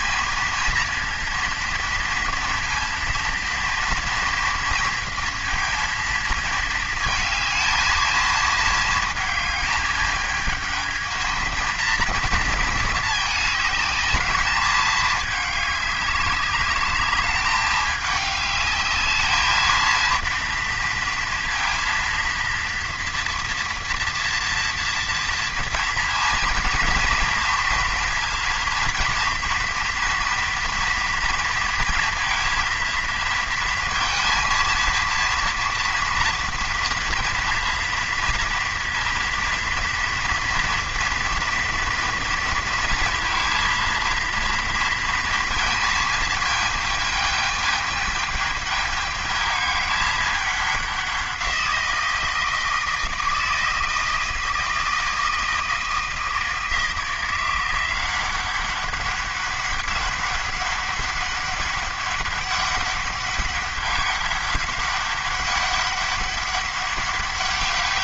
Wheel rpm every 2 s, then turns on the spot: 230, 230, 230, 220, 220, 220, 220, 210, 200, 210, 230, 230, 230, 230, 230, 240, 230, 230, 230, 230, 230, 230, 230, 220, 210, 200, 160, 160, 160, 190, 200, 200, 200, 200.
none